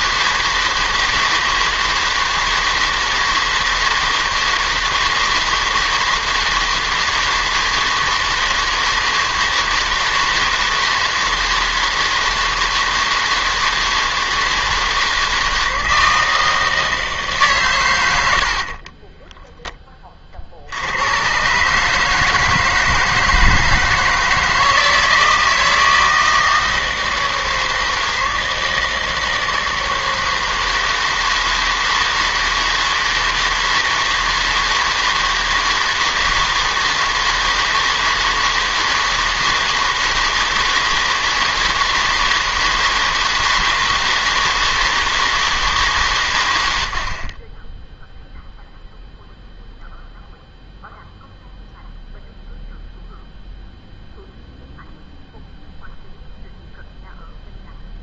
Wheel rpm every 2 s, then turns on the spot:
160, 160, 160, 160, 160, 160, 160, 160, 160, 40, 80, 160, 160, 160, 160, 160, 160, 160, 160, 160, 160, 160, 160, 80, 0, 0, 0, 0, 0.
18-20